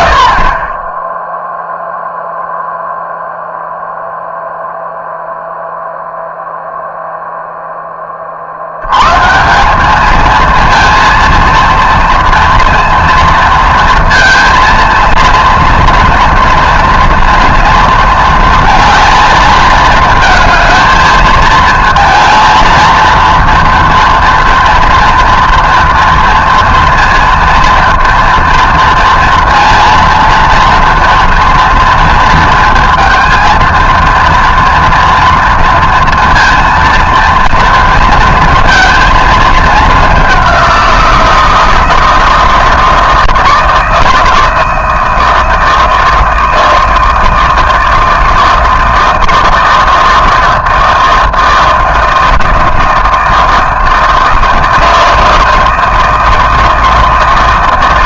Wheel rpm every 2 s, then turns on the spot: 20, 0, 0, 0, 90, 230, 230, 230, 230, 230, 220, 230, 230, 230, 230, 230, 230, 230, 230, 230, 180, 160, 160, 160, 160, 160, 160, 160, 160.
none